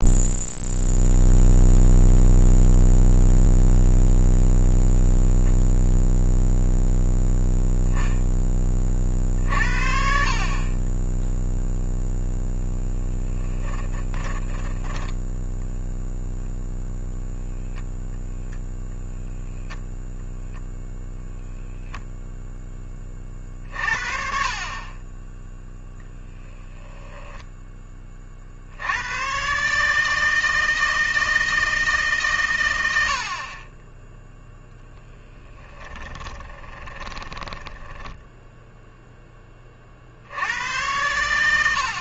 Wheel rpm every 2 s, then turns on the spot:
0, 0, 0, 0, 30, 20, 0, 10, 0, 0, 0, 10, 30, 10, 60, 160, 90, 0, 20, 0, 90.
14-16 26-28 36-38